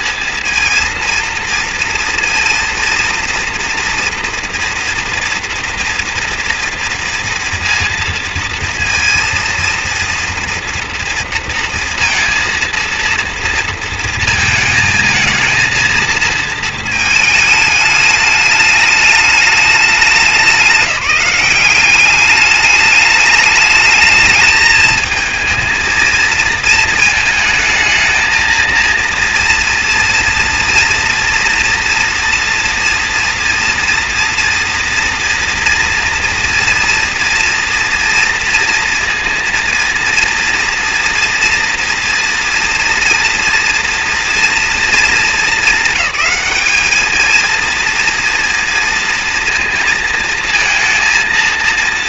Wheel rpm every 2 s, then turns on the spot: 230, 230, 230, 230, 230, 230, 230, 230, 230, 210, 200, 210, 220, 230, 230, 230, 230, 230, 230, 230, 230, 230, 230, 210, 230, 230.
none